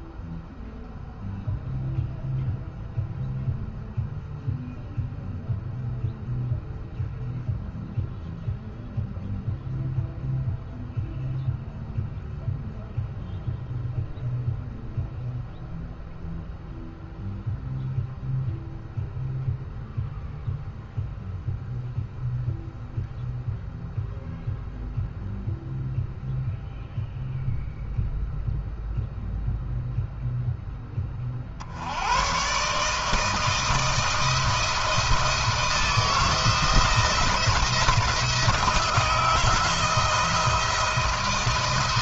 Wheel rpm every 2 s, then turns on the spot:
0, 0, 0, 0, 0, 0, 0, 0, 0, 0, 0, 0, 0, 0, 0, 10, 140, 170, 170, 160, 160.
none